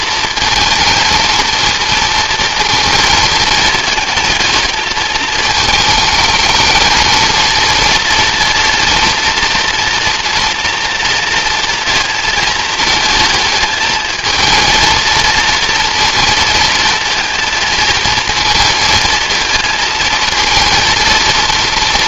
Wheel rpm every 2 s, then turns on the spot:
230, 230, 220, 220, 230, 240, 220, 220, 230, 230, 230.
none